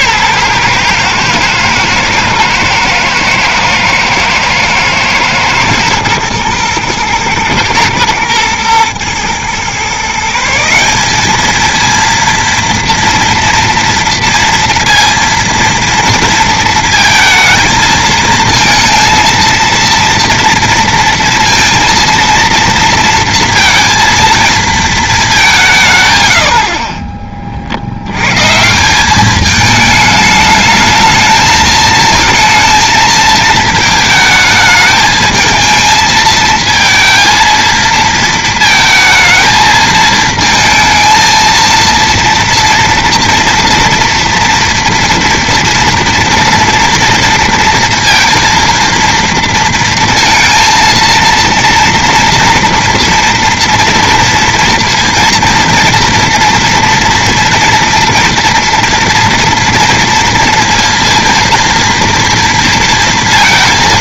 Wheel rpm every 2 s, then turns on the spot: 130, 120, 110, 120, 120, 170, 230, 230, 230, 230, 230, 230, 230, 60, 160, 220, 230, 220, 220, 220, 220, 230, 230, 230, 230, 230, 230, 230, 230, 230, 230, 230.
none